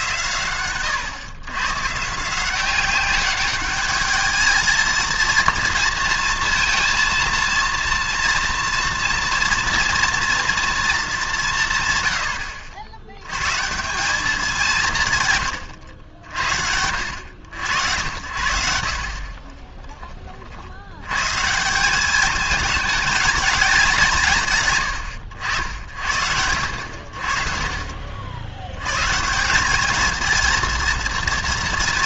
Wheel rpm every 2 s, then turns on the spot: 120, 180, 220, 230, 230, 230, 90, 180, 70, 70, 80, 210, 130, 70, 100, 230.
none